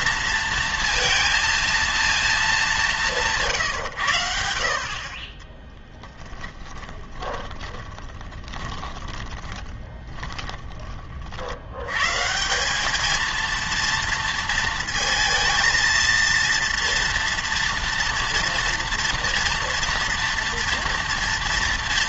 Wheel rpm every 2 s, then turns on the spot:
230, 210, 50, 10, 20, 30, 190, 230, 230, 230, 230.
6-12